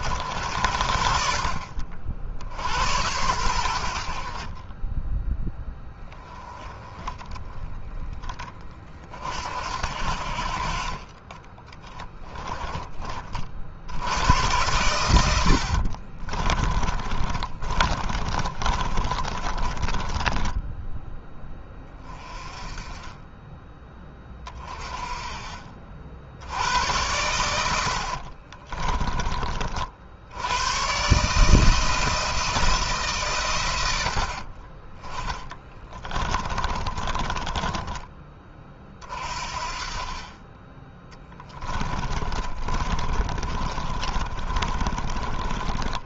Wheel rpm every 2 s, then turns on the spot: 60, 80, 20, 20, 40, 30, 20, 100, 30, 30, 10, 20, 30, 80, 20, 120, 150, 40, 20, 30, 20, 40, 30.
16-22 28-30 36-38 42-46